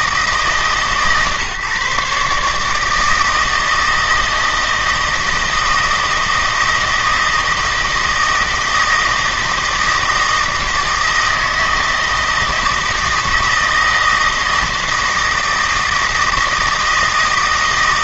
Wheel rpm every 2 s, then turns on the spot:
150, 150, 160, 160, 160, 160, 160, 160, 160.
none